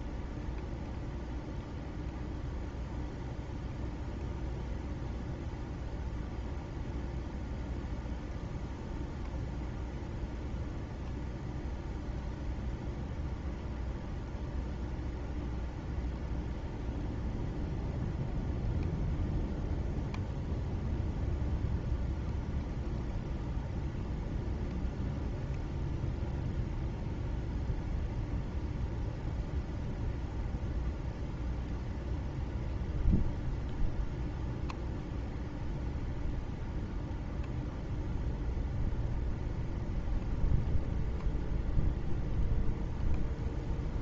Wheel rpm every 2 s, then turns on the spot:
0, 0, 0, 0, 0, 0, 0, 0, 0, 0, 0, 0, 0, 0, 0, 0, 0, 0, 0, 0, 0, 0.
none